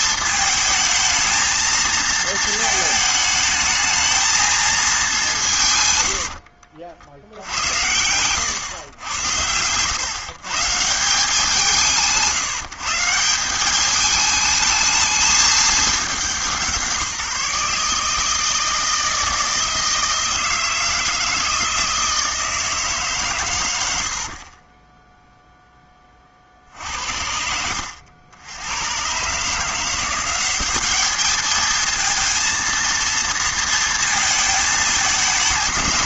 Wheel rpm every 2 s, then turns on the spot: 220, 220, 210, 60, 120, 170, 170, 220, 160, 160, 160, 150, 30, 60, 100, 200, 230, 220.
none